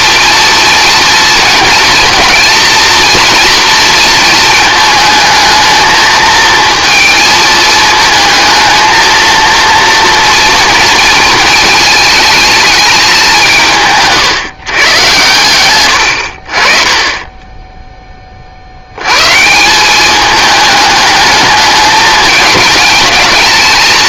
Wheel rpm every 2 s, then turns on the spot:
230, 230, 220, 230, 220, 230, 210, 120, 40, 90, 210, 220.
none